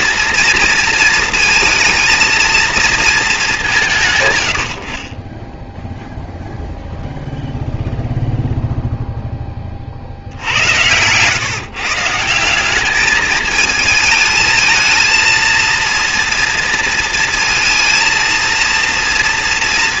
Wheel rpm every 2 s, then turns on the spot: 230, 230, 70, 0, 0, 90, 190, 220, 230, 230.
10-12